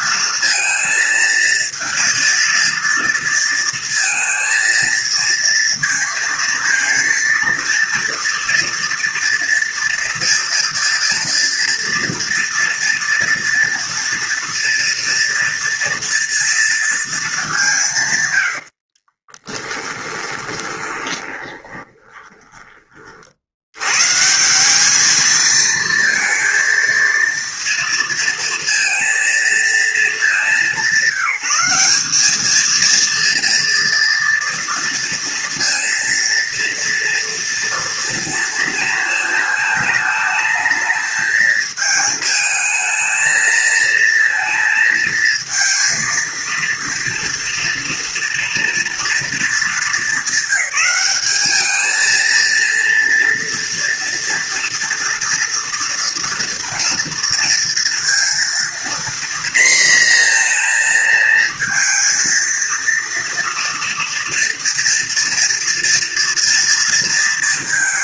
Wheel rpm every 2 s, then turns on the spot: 230, 230, 230, 230, 230, 230, 230, 230, 220, 40, 20, 50, 220, 230, 230, 190, 230, 230, 230, 220, 220, 220, 220, 230, 230, 200, 230, 230, 230, 230, 230, 230, 230, 230.
18-22